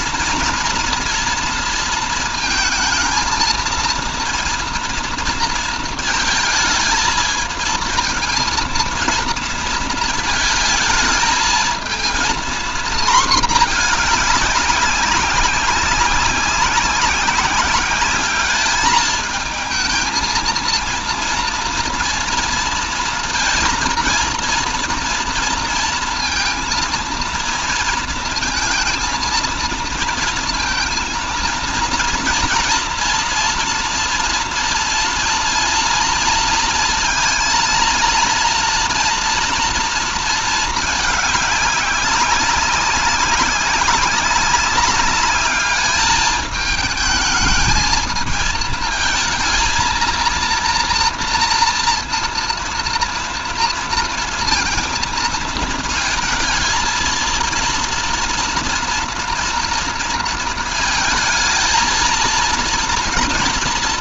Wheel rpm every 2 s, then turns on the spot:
230, 230, 230, 220, 230, 220, 230, 200, 190, 210, 230, 230, 240, 230, 230, 230, 230, 240, 230, 230, 220, 190, 200, 210, 230, 230, 230, 230, 220, 230, 230, 230.
none